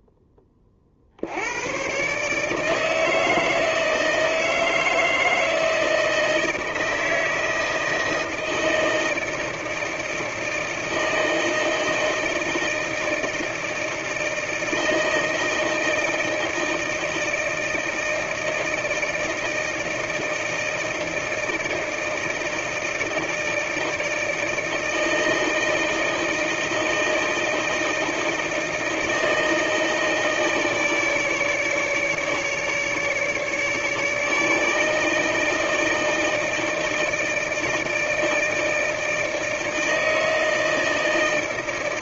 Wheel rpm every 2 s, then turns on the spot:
30, 160, 160, 160, 160, 160, 160, 160, 160, 160, 160, 160, 160, 160, 160, 160, 150, 160, 160, 160, 160.
none